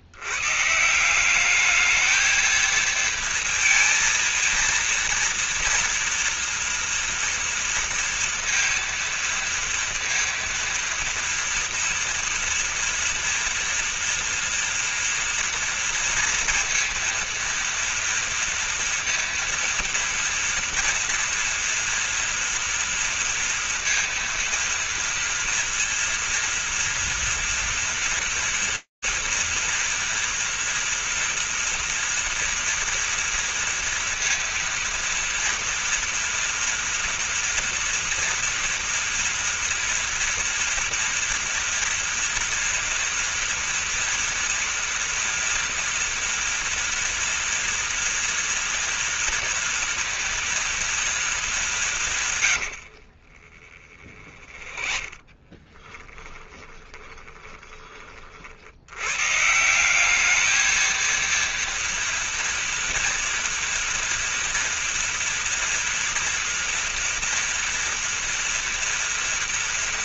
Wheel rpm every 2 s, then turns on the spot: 170, 230, 230, 230, 230, 230, 240, 230, 230, 230, 230, 230, 230, 230, 230, 230, 230, 230, 230, 230, 230, 230, 230, 240, 230, 230, 60, 20, 20, 110, 230, 230, 230, 230, 230.
52-58